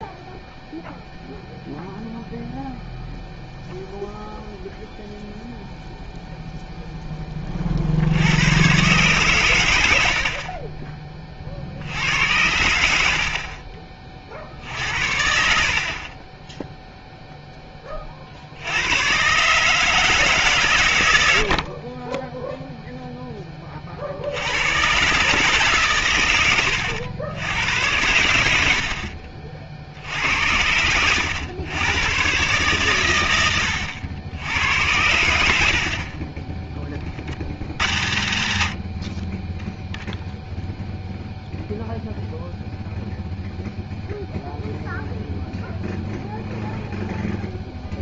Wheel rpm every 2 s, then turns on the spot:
0, 0, 0, 0, 80, 60, 90, 50, 20, 60, 140, 10, 80, 110, 100, 80, 130, 90, 20, 90, 0, 0, 0, 0.
none